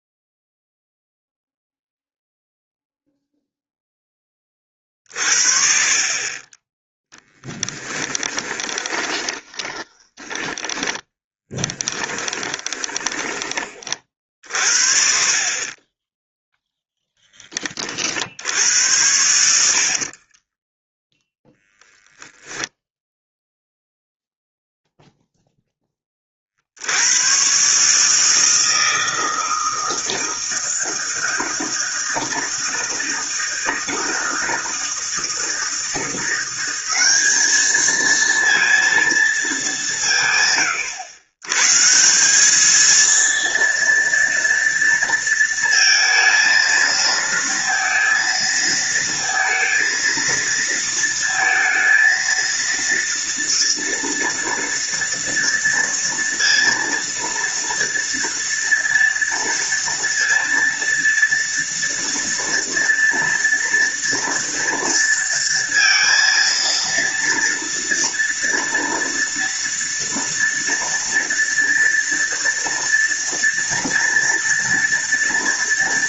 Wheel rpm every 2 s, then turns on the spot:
0, 0, 30, 20, 30, 20, 20, 60, 0, 90, 30, 0, 0, 70, 160, 160, 160, 160, 190, 230, 120, 220, 230, 230, 230, 230, 230, 230, 230, 230, 230, 240, 230, 230, 230, 240, 230, 230.
8-14 20-22